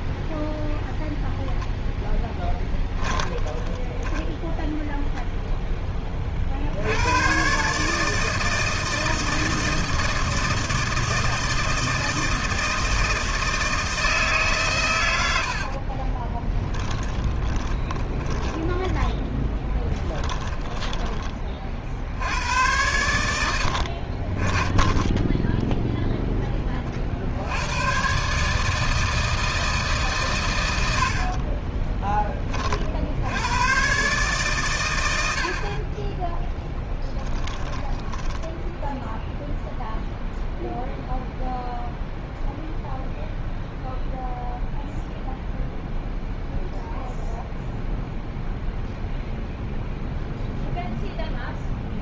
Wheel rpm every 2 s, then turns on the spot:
0, 20, 0, 80, 160, 160, 160, 120, 10, 10, 20, 90, 20, 40, 160, 90, 50, 110, 10, 10, 0, 0, 0, 0, 0, 0.
2-4 16-22 36-38